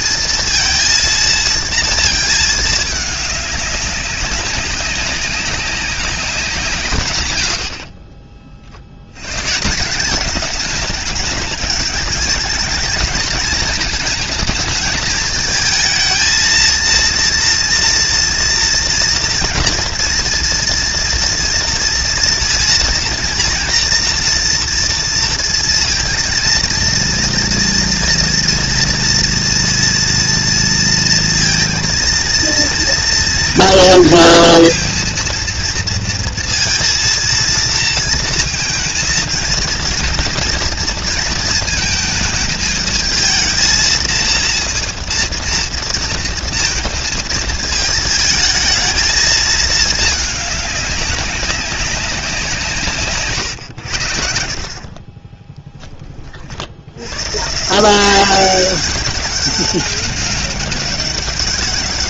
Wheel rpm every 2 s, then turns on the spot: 230, 220, 200, 180, 50, 190, 210, 220, 230, 230, 230, 230, 230, 230, 230, 230, 230, 230, 230, 230, 230, 220, 230, 230, 220, 210, 180, 60, 50, 190, 190.
none